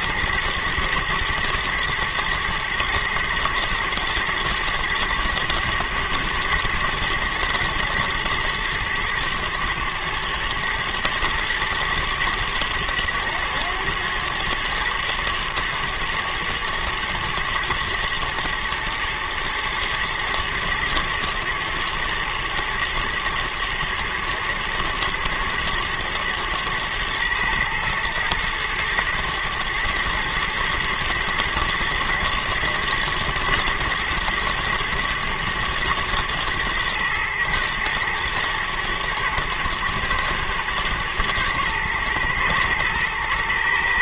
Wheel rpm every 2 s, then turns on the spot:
110, 110, 110, 120, 110, 110, 120, 120, 110, 110, 110, 110, 110, 120, 120, 110, 120, 120, 110, 110, 120, 120.
none